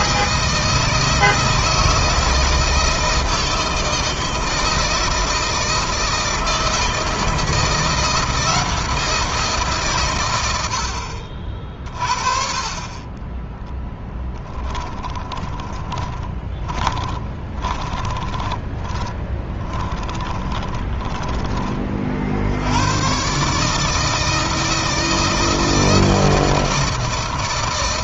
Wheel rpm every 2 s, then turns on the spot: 160, 160, 160, 160, 170, 90, 30, 20, 20, 20, 30, 100, 160, 160.
14-22